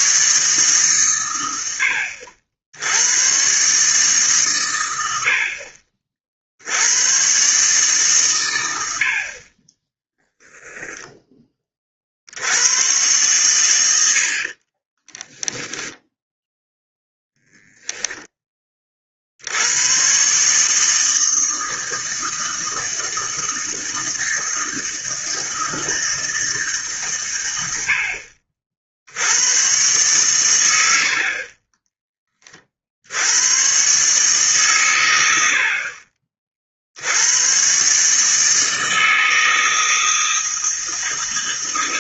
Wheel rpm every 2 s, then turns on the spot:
150, 80, 120, 70, 110, 10, 80, 50, 10, 20, 140, 160, 160, 160, 50, 100, 40, 140, 50, 160, 160.
10-12 14-16